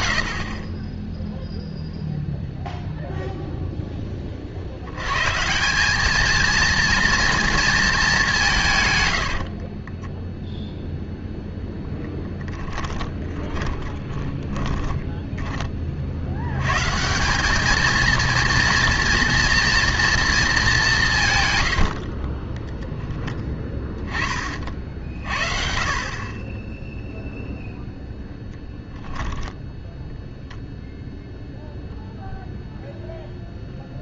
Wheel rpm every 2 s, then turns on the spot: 20, 0, 70, 230, 130, 0, 10, 20, 130, 230, 190, 10, 50, 10, 10, 0, 0.
12-16 28-30